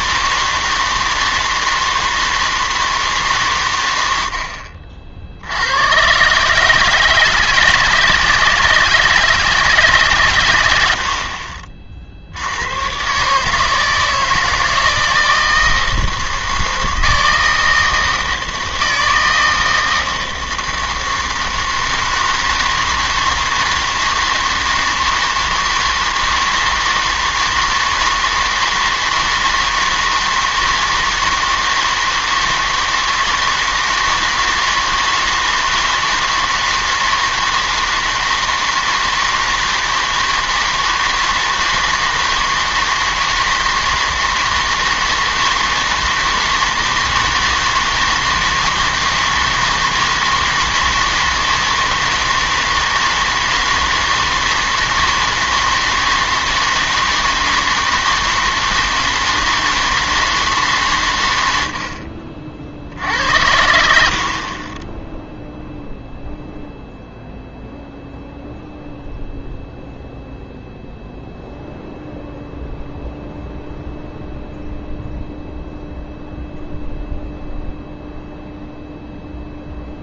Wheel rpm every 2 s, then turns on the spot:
160, 160, 60, 150, 160, 100, 100, 160, 160, 160, 160, 160, 160, 160, 160, 160, 160, 160, 160, 160, 160, 160, 160, 160, 160, 160, 160, 160, 160, 160, 140, 60, 30, 0, 0, 0, 0, 0, 0, 0.
none